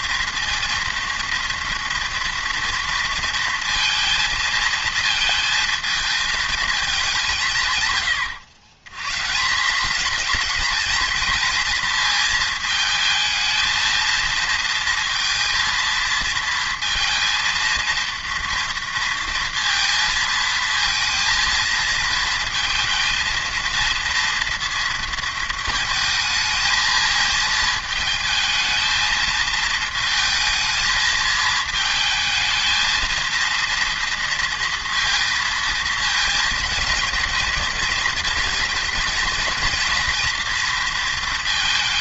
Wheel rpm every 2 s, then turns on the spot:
230, 230, 230, 220, 120, 220, 220, 230, 230, 230, 230, 220, 230, 220, 220, 220, 220, 230, 230, 220, 230.
none